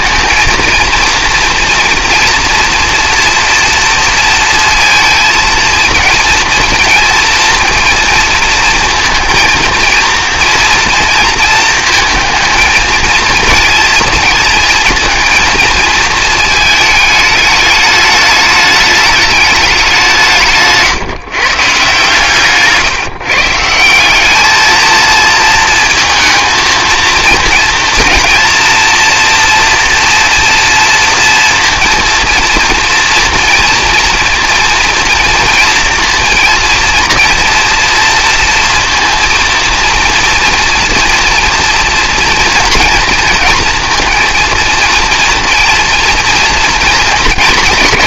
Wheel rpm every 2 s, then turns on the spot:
220, 230, 230, 230, 230, 230, 230, 220, 220, 210, 160, 140, 220, 220, 230, 230, 240, 230, 230, 230, 240, 230, 230, 230.
22-24